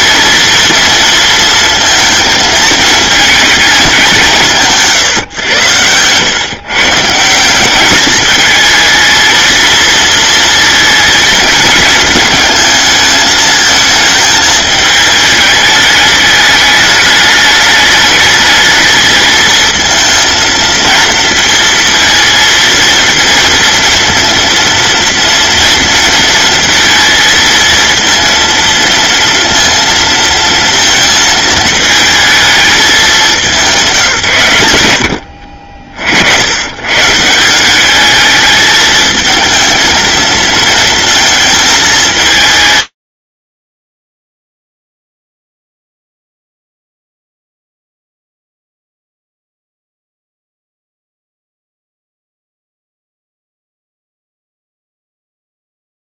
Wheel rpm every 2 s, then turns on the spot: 230, 220, 140, 150, 230, 230, 220, 210, 210, 220, 230, 230, 230, 230, 230, 230, 200, 80, 150, 220, 220, 140, 0, 0, 0, 0, 0, 0.
none